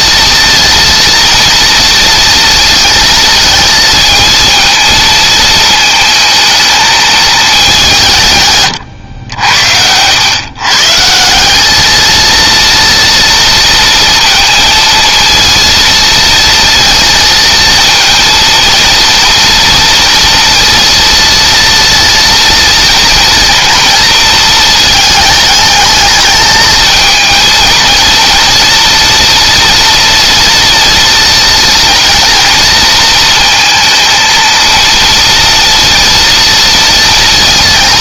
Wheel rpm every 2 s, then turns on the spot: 230, 220, 230, 220, 100, 160, 230, 230, 230, 230, 230, 230, 220, 230, 230, 230, 230, 230, 230.
none